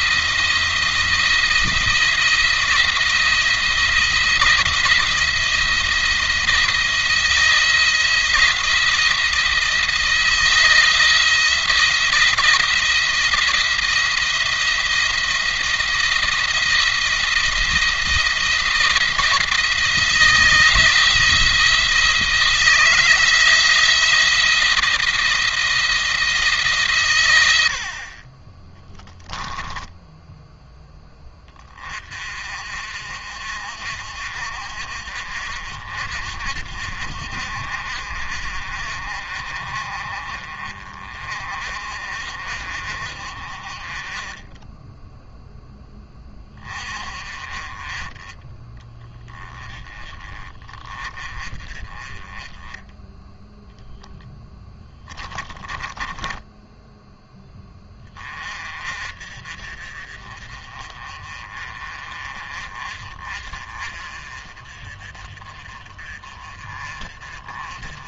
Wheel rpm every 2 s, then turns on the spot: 170, 170, 170, 170, 170, 160, 170, 170, 170, 170, 170, 160, 170, 140, 20, 10, 50, 50, 50, 50, 40, 50, 10, 30, 10, 30, 10, 10, 10, 40, 30, 40, 40, 40.
28-30 54-56